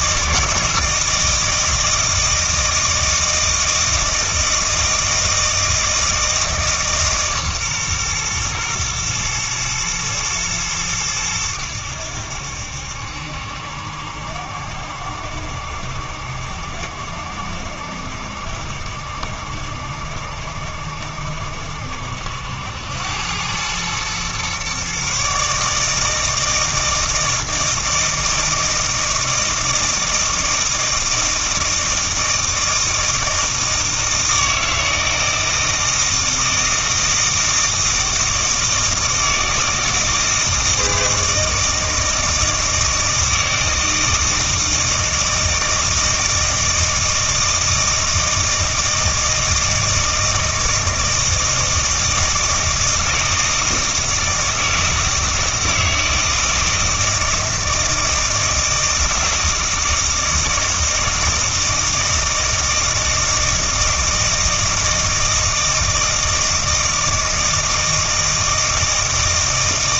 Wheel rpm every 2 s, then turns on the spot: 160, 160, 160, 150, 120, 110, 70, 70, 70, 60, 70, 90, 140, 160, 160, 160, 160, 160, 160, 160, 160, 160, 160, 160, 160, 160, 160, 160, 160, 160, 160, 160, 160, 160, 160.
none